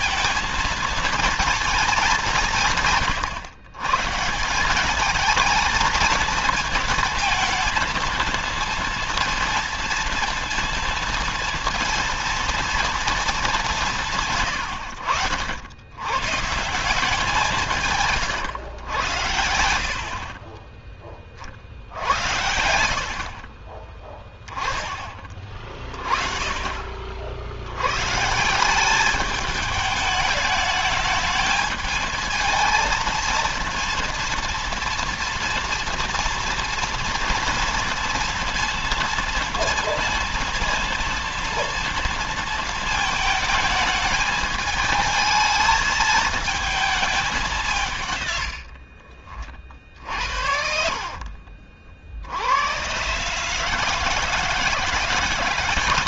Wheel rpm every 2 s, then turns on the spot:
230, 180, 170, 230, 230, 230, 230, 130, 150, 120, 30, 80, 20, 40, 170, 210, 220, 230, 230, 230, 230, 230, 220, 220, 80, 70, 90, 160.
48-52